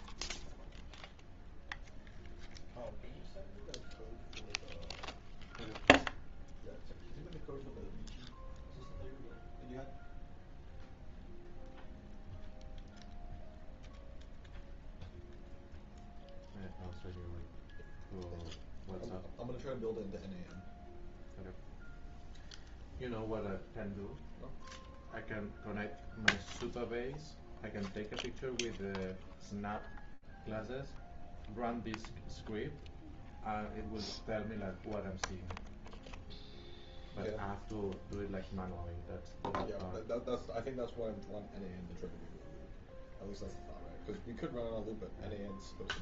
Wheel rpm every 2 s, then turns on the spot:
0, 0, 0, 0, 0, 0, 0, 0, 0, 0, 0, 0, 0, 0, 0, 0, 0, 0, 0, 0, 0, 0, 0.
none